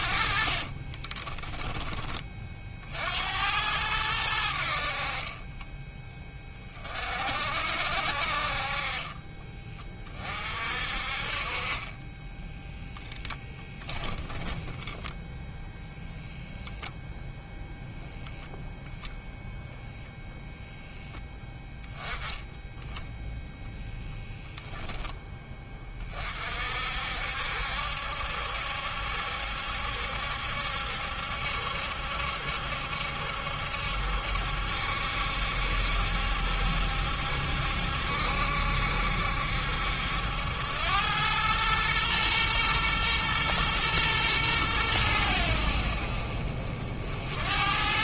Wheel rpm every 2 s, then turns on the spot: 40, 50, 60, 30, 50, 50, 0, 10, 0, 0, 0, 10, 0, 60, 70, 70, 70, 70, 70, 70, 90, 120, 100, 50.
0-2 14-16